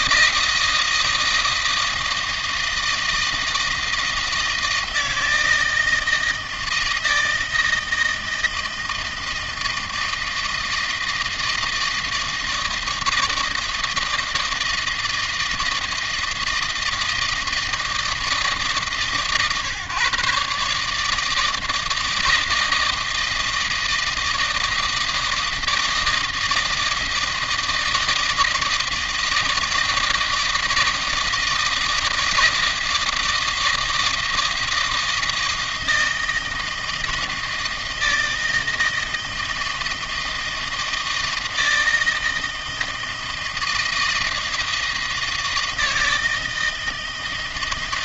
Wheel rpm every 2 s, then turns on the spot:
160, 160, 160, 160, 160, 160, 160, 160, 160, 140, 150, 160, 160, 160, 160, 160, 160, 160, 160, 160, 160, 160, 160, 160.
none